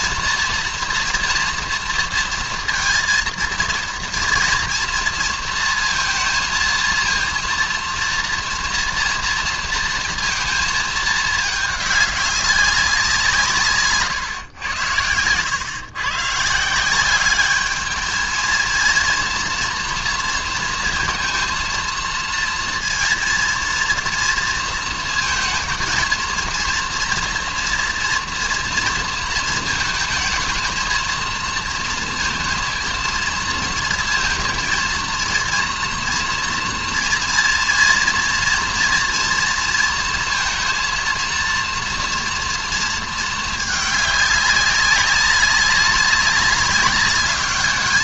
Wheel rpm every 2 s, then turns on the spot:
240, 230, 230, 230, 230, 230, 190, 100, 160, 220, 230, 230, 230, 230, 230, 220, 230, 230, 230, 230, 230, 230, 200, 200.
none